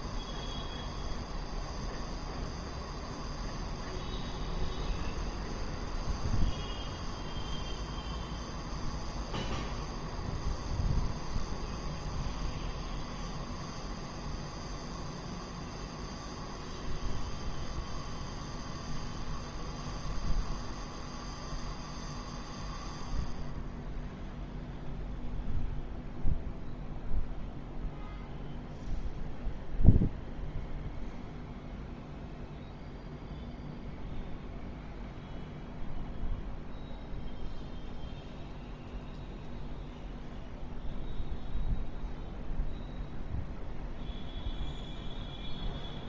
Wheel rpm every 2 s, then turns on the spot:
0, 0, 0, 0, 0, 0, 0, 0, 0, 0, 0, 0, 0, 0, 0, 0, 0, 0, 0, 0, 0, 0, 0.
none